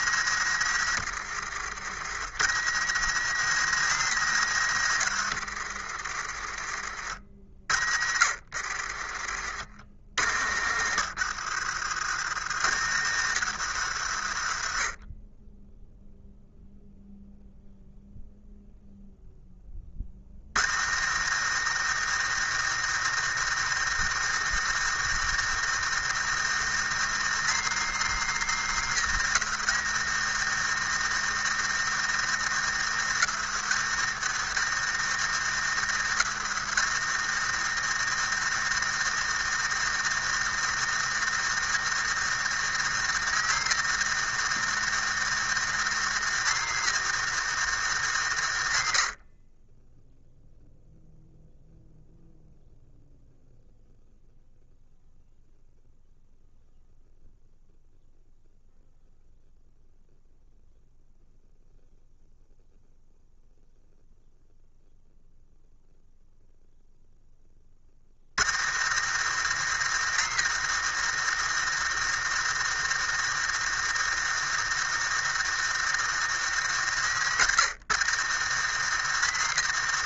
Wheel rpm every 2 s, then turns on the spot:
90, 80, 100, 40, 40, 70, 80, 40, 0, 0, 40, 110, 110, 110, 120, 110, 110, 110, 100, 110, 110, 110, 110, 110, 80, 0, 0, 0, 0, 0, 0, 0, 0, 0, 60, 110, 110, 110, 100, 100.
none